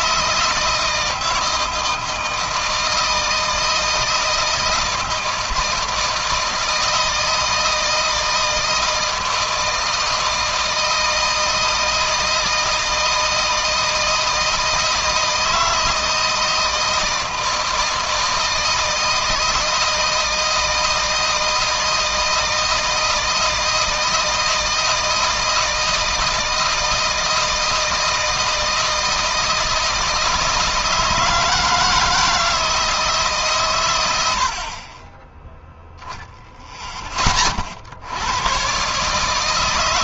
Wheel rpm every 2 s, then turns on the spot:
160, 160, 160, 160, 160, 160, 160, 160, 160, 160, 160, 160, 160, 160, 160, 160, 160, 30, 40, 140.
none